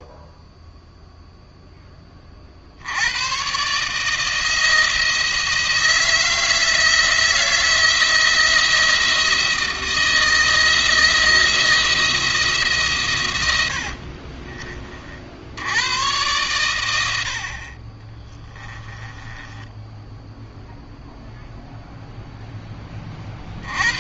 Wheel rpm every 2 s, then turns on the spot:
0, 90, 160, 160, 170, 160, 130, 50, 90, 20, 0, 30.
18-20